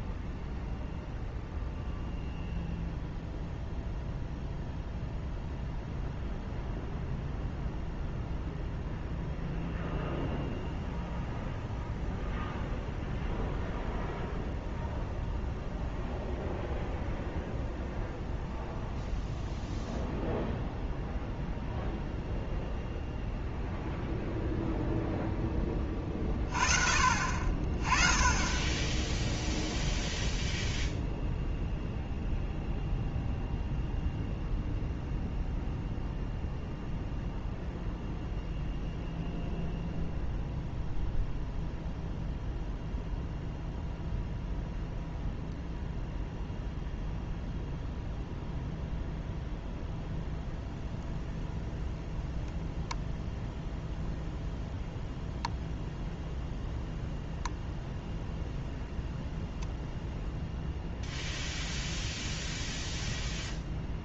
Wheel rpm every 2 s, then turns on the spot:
0, 0, 0, 0, 0, 0, 0, 0, 0, 0, 0, 0, 0, 30, 20, 0, 0, 0, 0, 0, 0, 0, 0, 0, 0, 0, 0, 0, 0, 0, 0, 0.
none